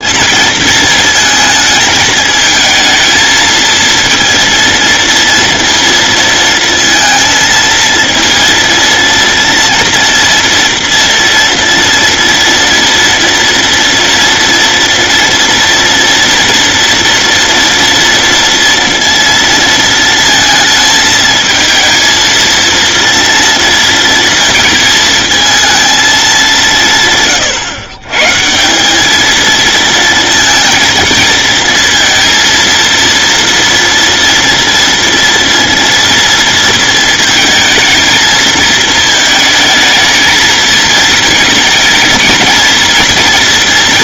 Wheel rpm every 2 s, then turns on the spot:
230, 220, 230, 230, 230, 230, 230, 230, 230, 230, 220, 230, 220, 190, 170, 230, 230, 230, 230, 220, 220, 230.
none